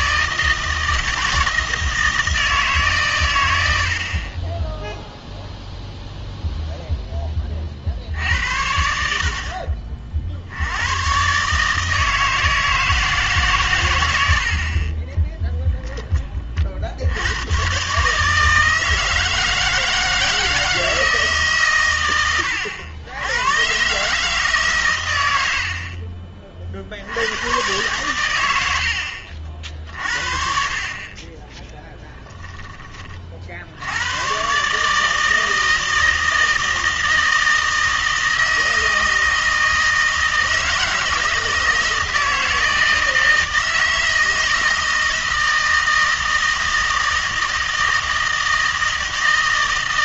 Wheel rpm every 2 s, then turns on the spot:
160, 140, 10, 0, 80, 90, 160, 30, 60, 160, 160, 90, 130, 50, 80, 40, 20, 140, 160, 160, 160, 160, 160, 160, 160.
none